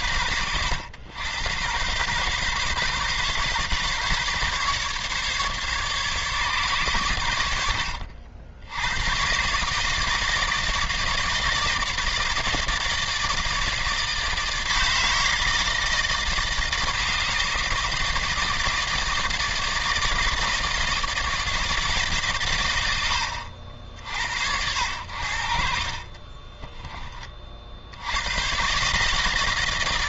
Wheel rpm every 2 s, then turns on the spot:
80, 130, 140, 130, 80, 160, 160, 160, 160, 160, 160, 90, 80, 20, 130.
26-28